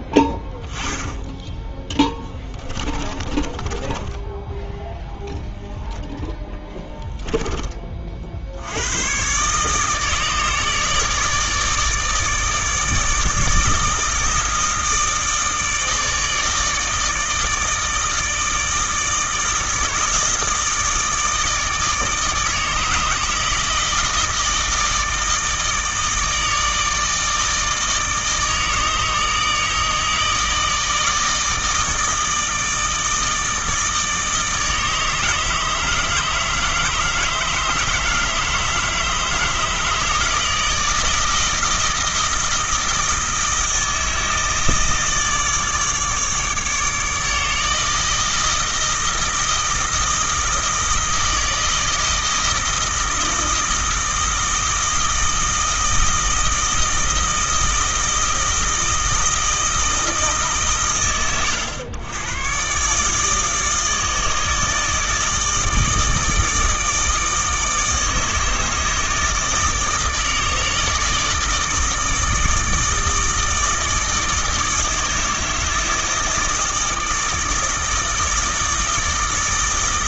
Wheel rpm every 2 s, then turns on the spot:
10, 20, 10, 10, 80, 150, 150, 160, 160, 160, 160, 160, 160, 160, 160, 160, 160, 160, 150, 160, 160, 160, 160, 150, 160, 160, 160, 160, 160, 160, 130, 130, 160, 160, 160, 160, 160, 160, 160, 160.
2-6